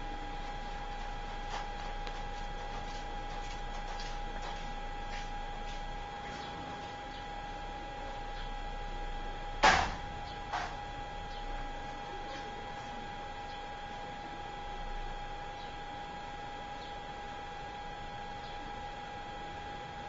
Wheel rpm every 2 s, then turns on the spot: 0, 0, 0, 0, 0, 0, 0, 0, 0, 0.
none